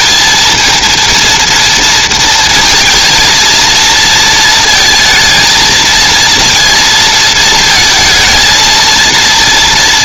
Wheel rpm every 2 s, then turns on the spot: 230, 230, 230, 230, 230.
none